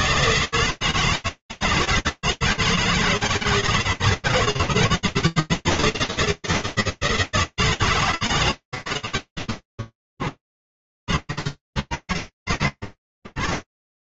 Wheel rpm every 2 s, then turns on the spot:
140, 160, 160, 160, 160, 110, 110.
none